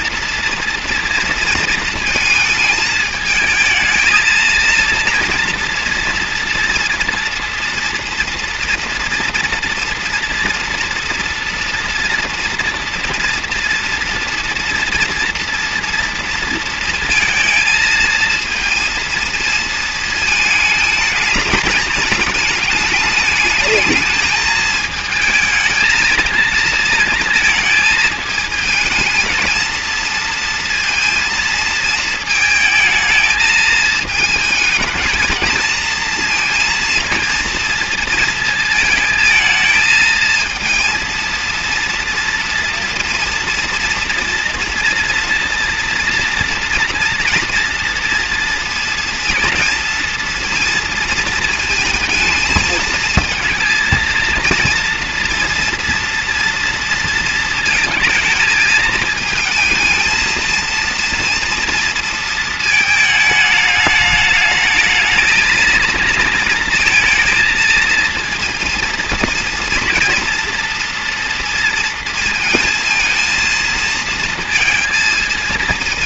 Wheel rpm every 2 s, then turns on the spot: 230, 220, 230, 230, 240, 240, 230, 230, 230, 230, 220, 210, 220, 230, 220, 230, 220, 220, 230, 220, 230, 240, 230, 230, 230, 230, 220, 230, 230, 220, 230, 220, 220, 230, 230, 230, 230, 230.
none